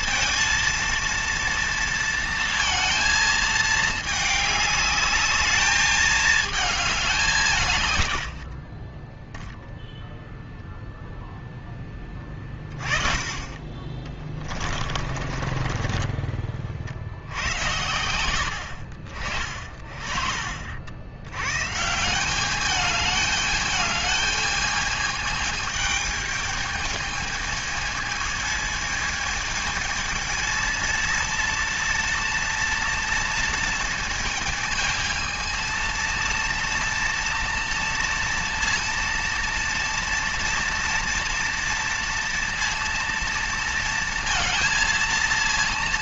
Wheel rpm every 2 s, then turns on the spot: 230, 220, 210, 200, 30, 0, 30, 40, 60, 60, 80, 210, 220, 220, 220, 230, 230, 220, 230, 230, 230, 230, 230.
8-10 14-16